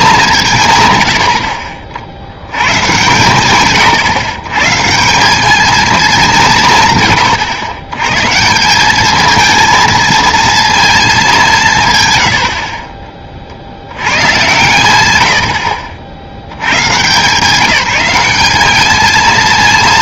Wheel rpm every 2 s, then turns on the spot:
140, 110, 140, 150, 180, 230, 50, 110, 100, 210.
none